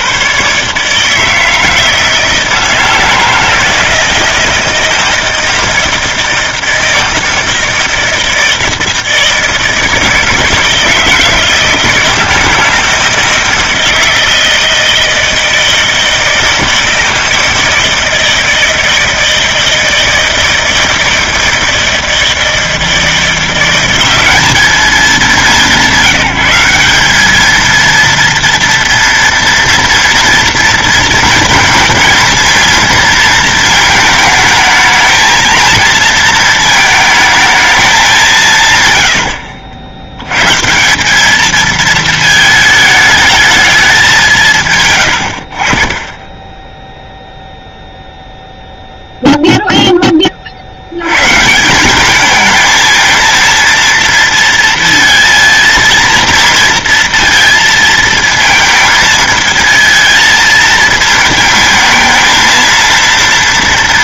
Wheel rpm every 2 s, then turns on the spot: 150, 160, 160, 160, 160, 160, 160, 160, 160, 160, 160, 160, 210, 190, 230, 230, 230, 220, 220, 130, 160, 220, 120, 0, 0, 80, 220, 230, 230, 230, 230, 230.
none